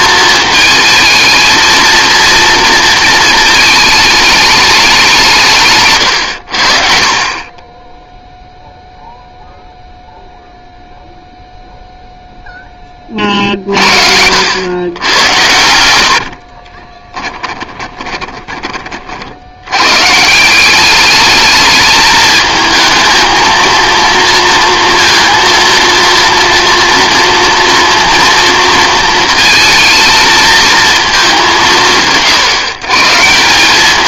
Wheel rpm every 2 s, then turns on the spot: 220, 230, 210, 80, 0, 0, 20, 100, 30, 30, 190, 220, 230, 230, 230, 220, 140.
16-18